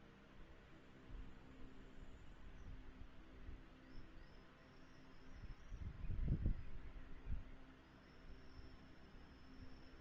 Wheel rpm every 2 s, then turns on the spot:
0, 0, 0, 0, 0.
none